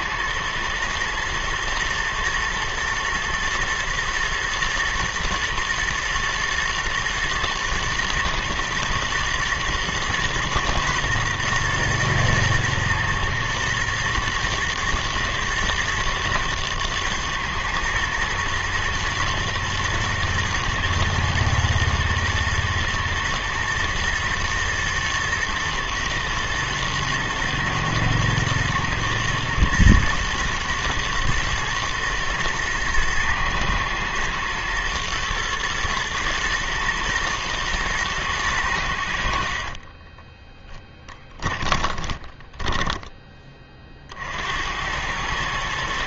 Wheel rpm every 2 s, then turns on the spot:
110, 120, 110, 110, 110, 120, 110, 110, 110, 110, 110, 120, 120, 120, 120, 110, 120, 120, 120, 90, 10, 20, 90.
40-44